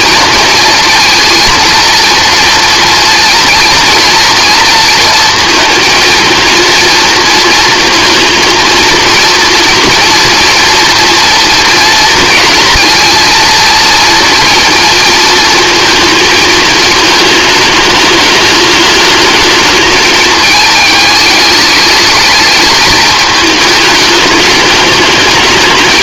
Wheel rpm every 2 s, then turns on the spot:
230, 230, 230, 230, 230, 230, 230, 230, 220, 210, 210, 220, 210.
none